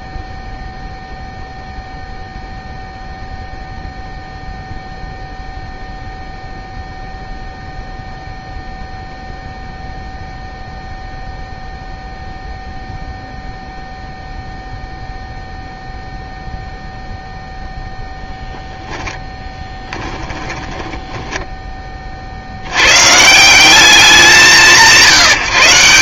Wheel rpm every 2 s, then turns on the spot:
0, 0, 0, 0, 0, 0, 0, 0, 0, 10, 10, 90, 170.
20-22